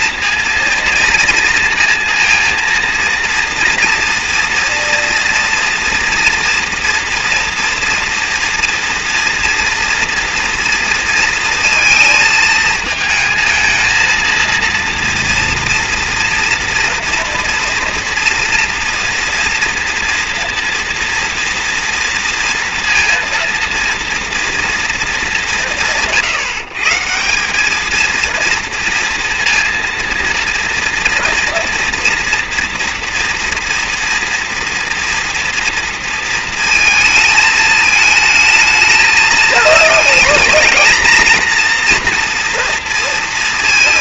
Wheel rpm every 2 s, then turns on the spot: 230, 230, 230, 230, 230, 230, 220, 230, 230, 230, 230, 230, 230, 150, 230, 230, 230, 230, 230, 220, 230, 230.
none